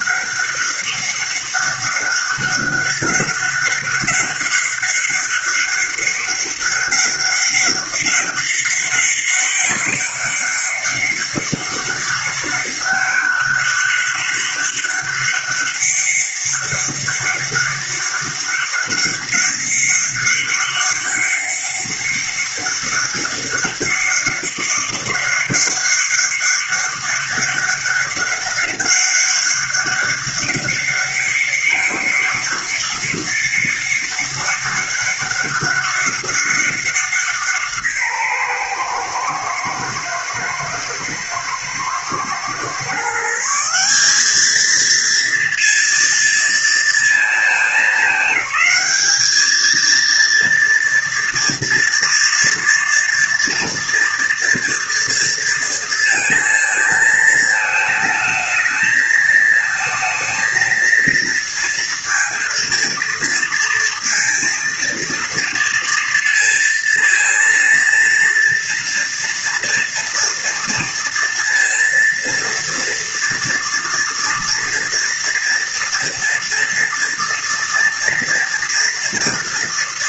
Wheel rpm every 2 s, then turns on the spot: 200, 200, 200, 190, 200, 200, 200, 200, 200, 200, 200, 200, 200, 200, 200, 200, 200, 190, 200, 140, 120, 120, 210, 230, 210, 230, 230, 230, 220, 220, 230, 230, 230, 230, 230, 230, 230, 230, 230, 240.
none